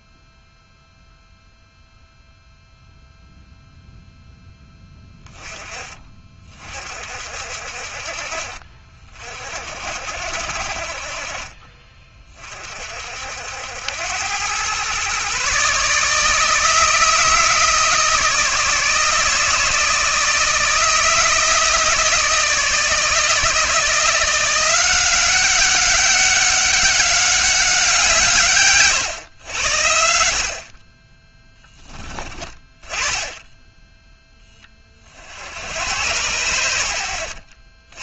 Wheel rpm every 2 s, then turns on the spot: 0, 0, 10, 40, 40, 40, 50, 120, 160, 160, 160, 160, 180, 200, 130, 30, 20, 40, 90.
none